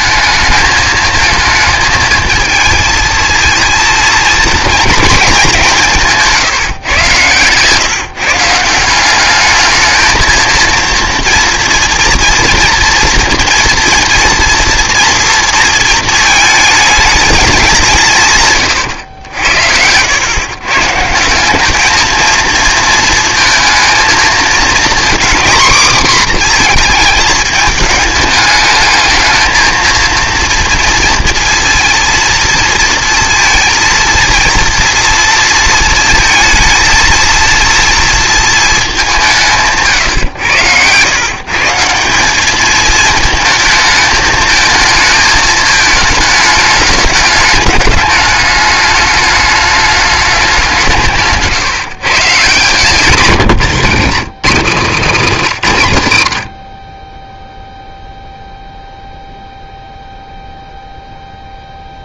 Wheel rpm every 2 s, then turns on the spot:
220, 220, 220, 160, 170, 230, 230, 230, 220, 130, 130, 230, 230, 240, 210, 230, 230, 230, 220, 220, 110, 210, 220, 210, 210, 190, 160, 180, 50, 0, 0.
52-54